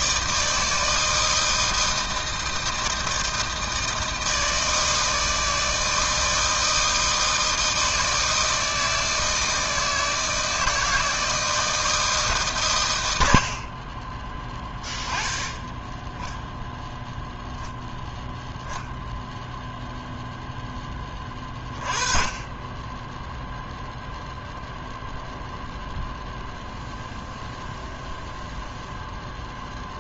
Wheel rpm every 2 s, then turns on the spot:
160, 160, 160, 160, 160, 160, 90, 10, 0, 0, 20, 10, 0, 0, 0.
none